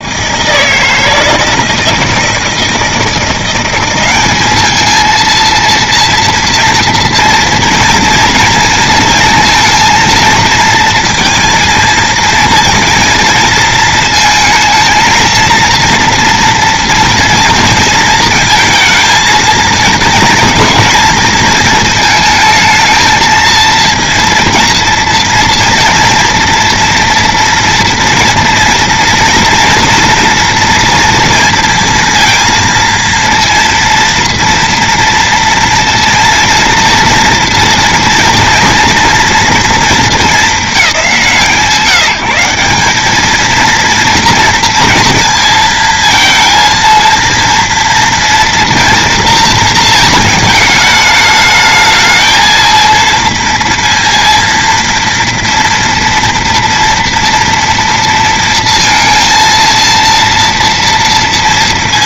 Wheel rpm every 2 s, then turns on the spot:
160, 160, 220, 230, 230, 230, 230, 230, 230, 220, 220, 220, 230, 230, 230, 230, 230, 230, 230, 230, 180, 190, 230, 230, 230, 210, 230, 230, 230, 230, 230.
none